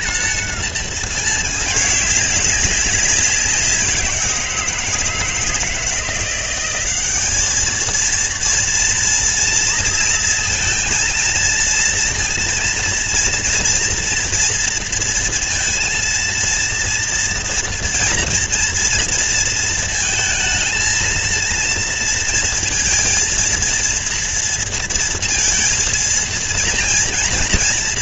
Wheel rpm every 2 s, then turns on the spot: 230, 210, 180, 170, 220, 230, 230, 230, 230, 230, 230, 230, 230, 230.
none